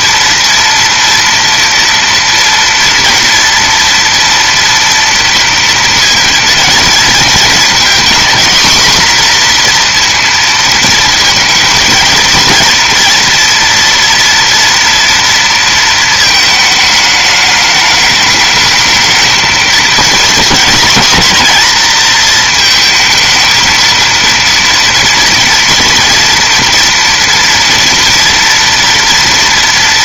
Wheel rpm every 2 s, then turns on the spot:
230, 230, 230, 230, 240, 230, 230, 240, 220, 210, 240, 220, 230, 230, 230.
none